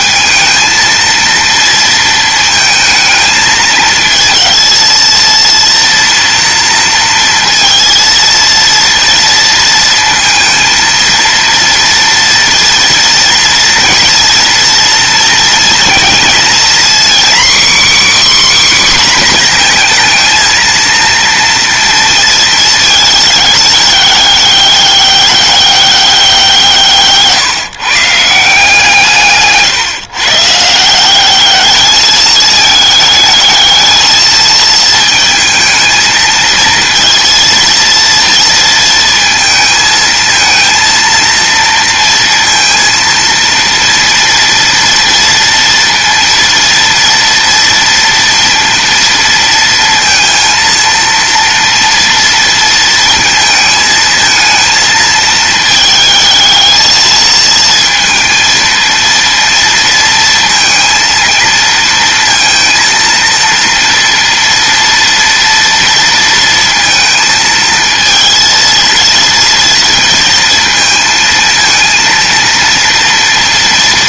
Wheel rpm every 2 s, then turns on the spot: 220, 220, 230, 230, 230, 230, 230, 230, 250, 270, 230, 220, 200, 170, 160, 170, 210, 220, 230, 230, 230, 230, 230, 230, 230, 230, 230, 220, 220, 230, 230, 230, 230, 230, 230, 230, 230.
none